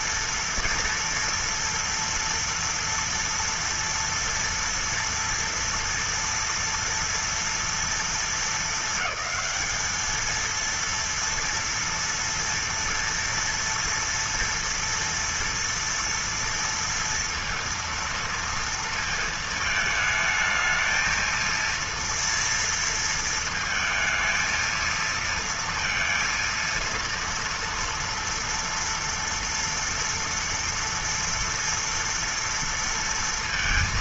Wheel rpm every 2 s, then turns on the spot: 230, 230, 230, 230, 220, 230, 230, 230, 230, 230, 220, 230, 230, 230, 230, 230, 230.
none